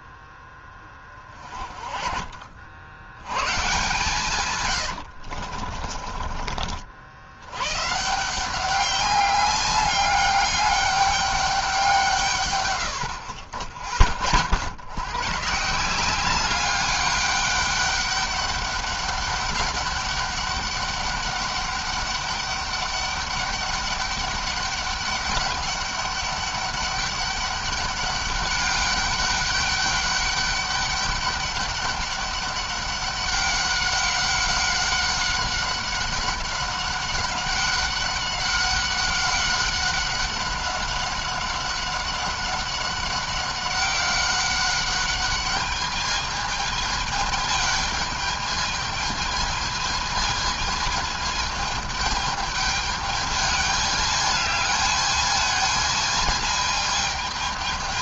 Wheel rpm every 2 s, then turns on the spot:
20, 100, 100, 60, 190, 200, 100, 90, 200, 200, 200, 200, 200, 200, 200, 200, 200, 190, 190, 190, 190, 190, 200, 220, 220, 220, 210, 210, 220.
4-6